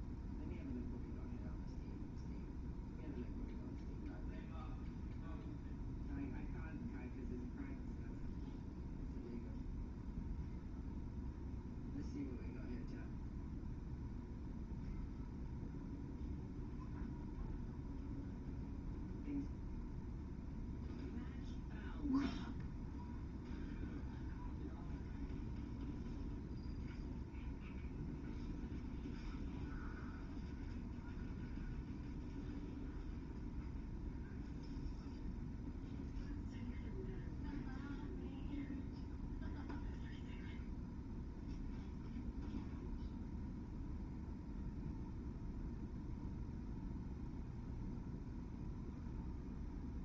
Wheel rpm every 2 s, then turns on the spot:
0, 0, 0, 0, 0, 0, 0, 0, 0, 0, 0, 0, 0, 0, 0, 0, 0, 0, 0, 0, 0, 0, 0, 0, 0.
none